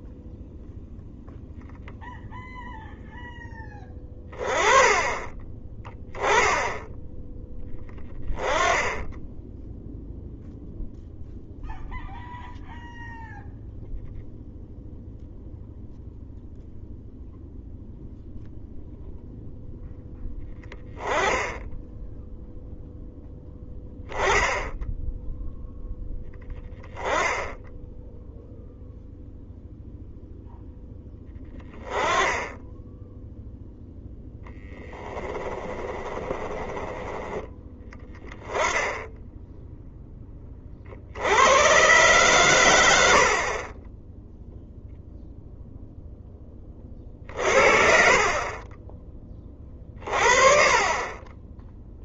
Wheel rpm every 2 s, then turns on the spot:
0, 0, 20, 10, 10, 0, 0, 0, 0, 0, 10, 0, 0, 10, 0, 0, 10, 10, 10, 10, 50, 110, 0, 20, 20, 30.
34-36